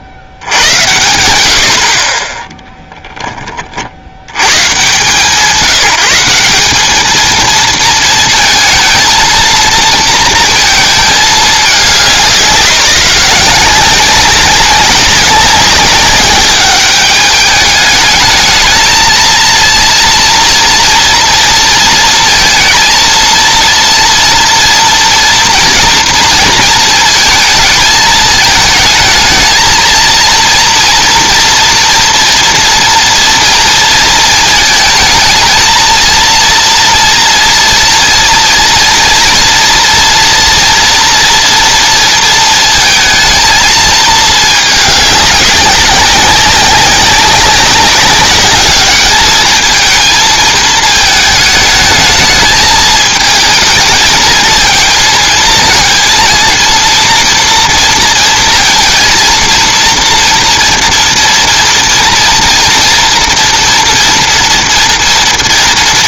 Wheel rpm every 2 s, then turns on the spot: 60, 10, 120, 190, 220, 230, 180, 190, 200, 220, 230, 230, 240, 220, 220, 230, 240, 230, 230, 230, 230, 230, 210, 190, 210, 220, 210, 220, 230, 230, 240, 230, 230.
none